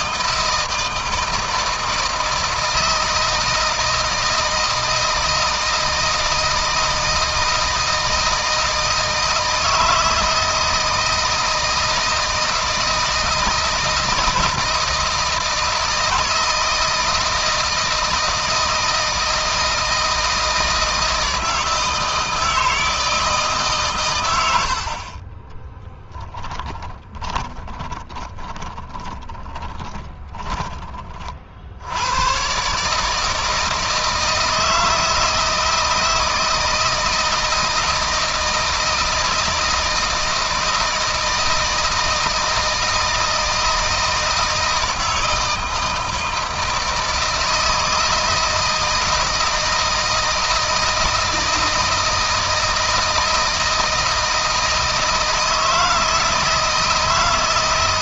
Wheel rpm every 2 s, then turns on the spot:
160, 160, 160, 160, 160, 160, 160, 160, 160, 160, 160, 160, 90, 10, 10, 20, 140, 160, 160, 160, 160, 160, 160, 160, 160, 160, 160, 160, 160.
26-30